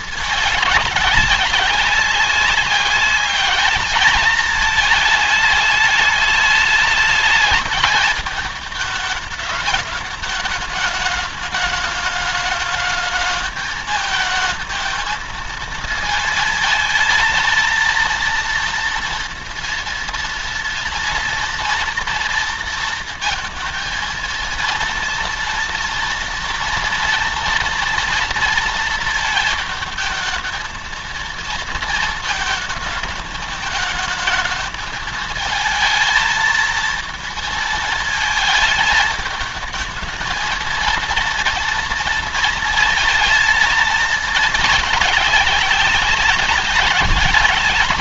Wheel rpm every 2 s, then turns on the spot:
210, 190, 220, 210, 210, 210, 220, 220, 220, 230, 230, 230, 230, 230, 230, 220, 220, 220, 230, 220, 230, 230, 210, 200.
none